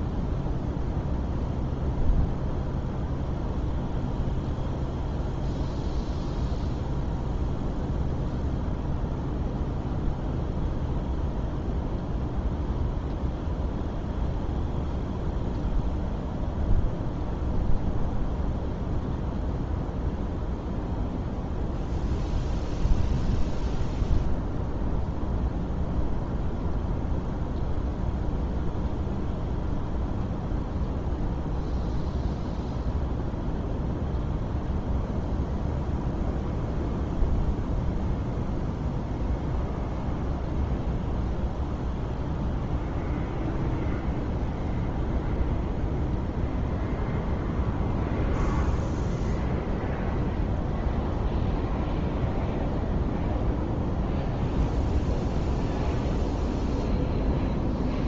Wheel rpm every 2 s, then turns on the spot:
0, 0, 0, 0, 0, 0, 0, 0, 0, 0, 0, 0, 0, 0, 0, 0, 0, 0, 0, 0, 0, 0, 0, 0, 0, 0, 0, 0, 0.
none